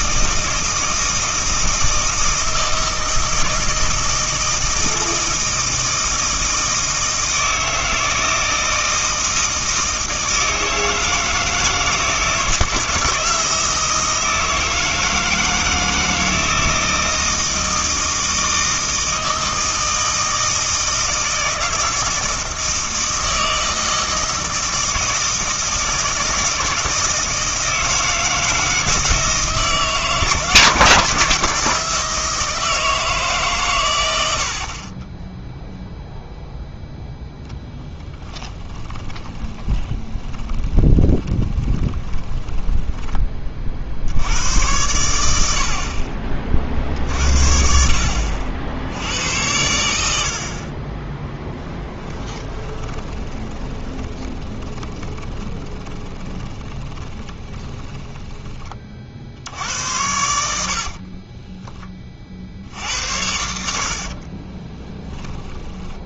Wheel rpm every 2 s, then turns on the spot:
160, 160, 160, 160, 160, 160, 160, 160, 160, 160, 160, 160, 160, 160, 160, 160, 160, 60, 0, 10, 20, 10, 90, 50, 80, 30, 20, 20, 20, 30, 60, 80, 20.
38-44 52-58 60-62 64-66